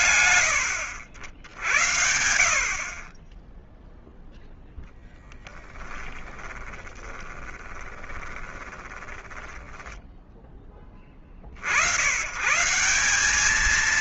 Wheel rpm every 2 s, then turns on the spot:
100, 30, 10, 20, 10, 60, 220.
4-10